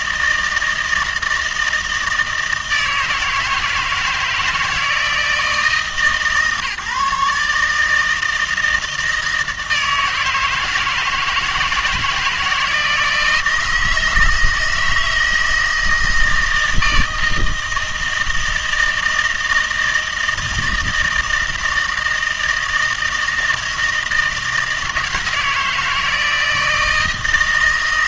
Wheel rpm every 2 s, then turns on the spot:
160, 170, 160, 150, 160, 160, 160, 160, 160, 160, 160, 160, 160, 160.
none